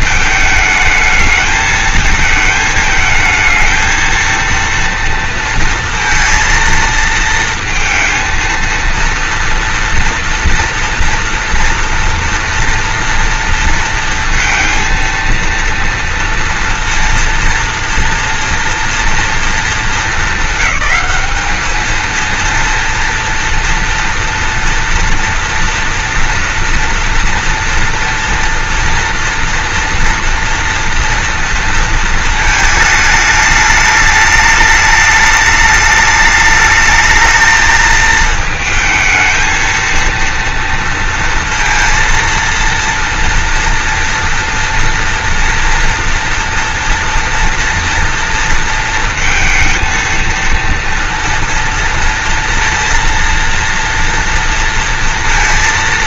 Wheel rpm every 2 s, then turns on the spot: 220, 220, 230, 230, 230, 230, 230, 230, 230, 230, 220, 230, 230, 230, 230, 230, 220, 210, 210, 220, 230, 230, 230, 230, 230, 230, 230, 230.
none